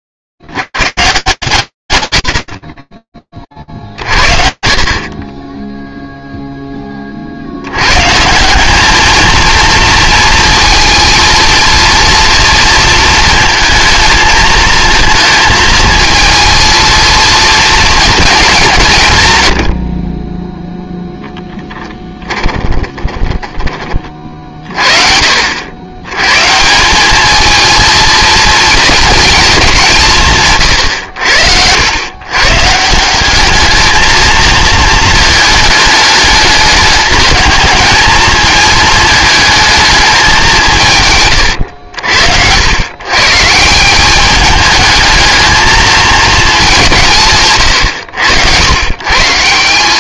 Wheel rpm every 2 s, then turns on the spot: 70, 40, 60, 0, 170, 230, 230, 220, 230, 200, 10, 20, 50, 190, 230, 110, 170, 220, 210, 220, 140, 120, 220, 170, 130.
22-24